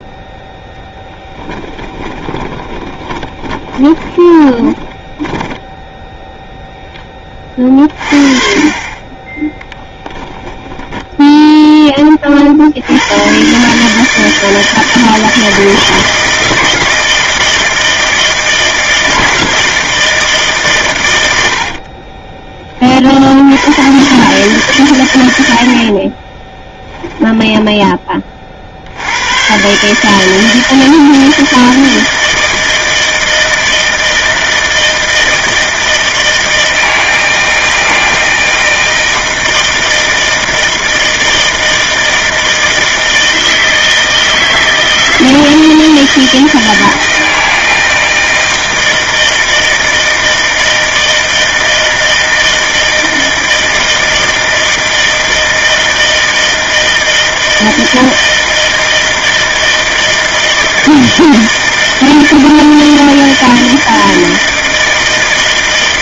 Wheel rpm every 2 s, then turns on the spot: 0, 20, 30, 0, 30, 20, 50, 160, 160, 160, 160, 10, 130, 30, 30, 160, 160, 160, 160, 160, 160, 160, 160, 160, 160, 160, 160, 160, 160, 160, 160, 160, 160.
2-6 8-12 26-28